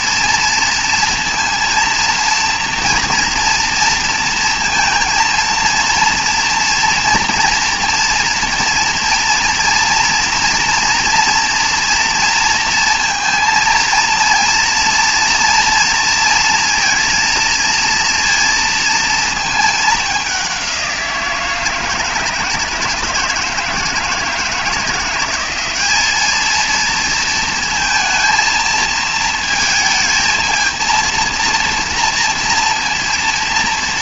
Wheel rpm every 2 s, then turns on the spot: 230, 230, 230, 240, 230, 230, 230, 230, 230, 230, 190, 160, 170, 220, 220, 230, 230.
none